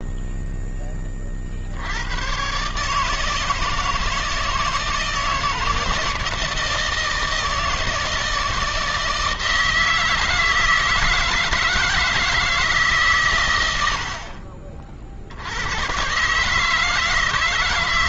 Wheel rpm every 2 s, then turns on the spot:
10, 140, 160, 170, 160, 160, 150, 60, 160.
none